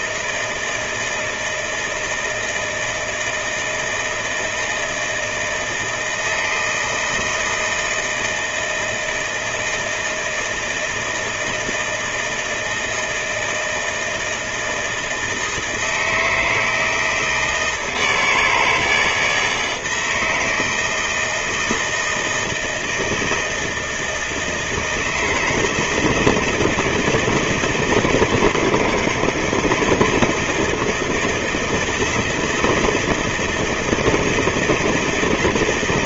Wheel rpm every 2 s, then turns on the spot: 160, 160, 160, 160, 160, 160, 160, 160, 160, 160, 160, 160, 160, 160, 160, 170, 170, 160.
none